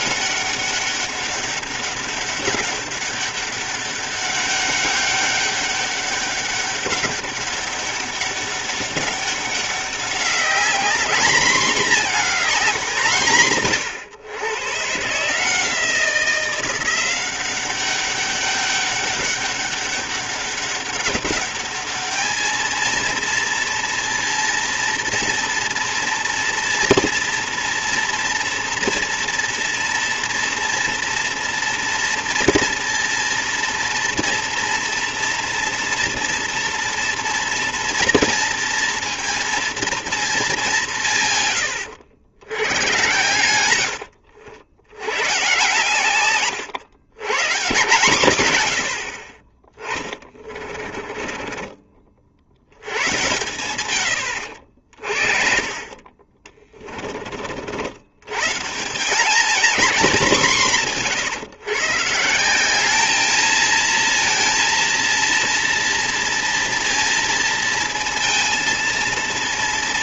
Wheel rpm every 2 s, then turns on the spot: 200, 200, 200, 200, 200, 220, 190, 120, 180, 200, 200, 230, 230, 230, 230, 230, 230, 230, 230, 230, 190, 100, 80, 130, 80, 40, 80, 60, 30, 160, 180, 200, 230, 230, 230.
50-52 54-58